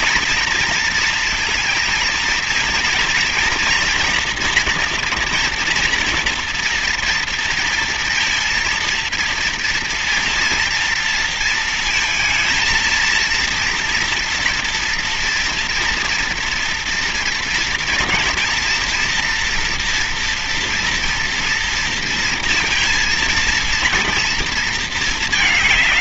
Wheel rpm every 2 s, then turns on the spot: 230, 230, 240, 230, 230, 230, 230, 240, 240, 230, 230, 230, 230.
none